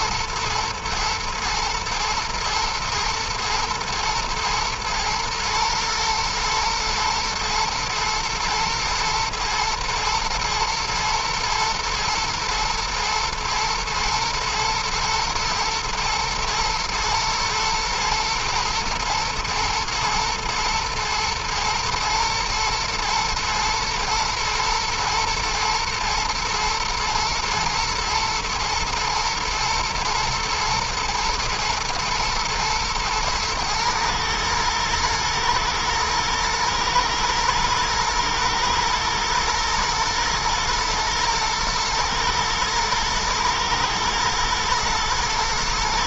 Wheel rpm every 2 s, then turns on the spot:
110, 120, 110, 120, 110, 110, 110, 110, 110, 110, 120, 110, 110, 120, 120, 120, 120, 110, 120, 120, 110, 110, 120.
none